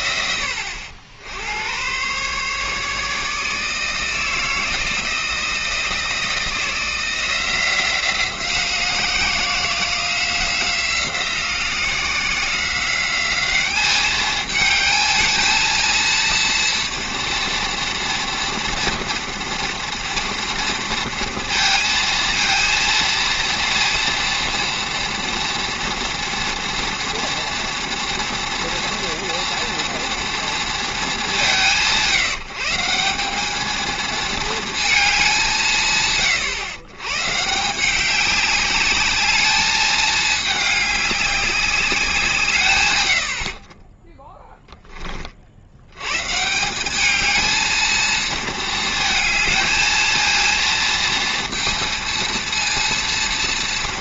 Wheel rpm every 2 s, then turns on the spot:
90, 140, 160, 160, 170, 180, 180, 210, 230, 230, 230, 230, 230, 230, 230, 230, 160, 220, 110, 200, 210, 140, 10, 170, 230, 230, 230.
none